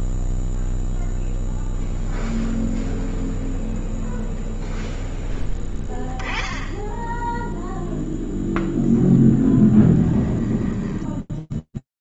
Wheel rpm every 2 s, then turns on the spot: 0, 0, 10, 20, 10, 30.
8-10